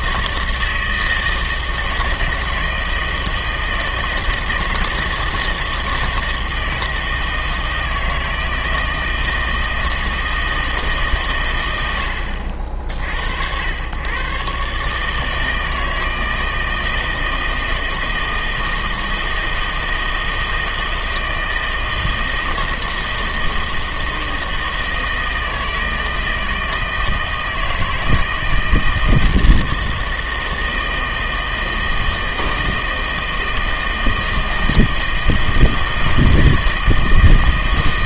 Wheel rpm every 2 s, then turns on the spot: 160, 160, 160, 160, 160, 160, 50, 140, 160, 160, 160, 160, 160, 160, 160, 160, 160, 160, 160.
none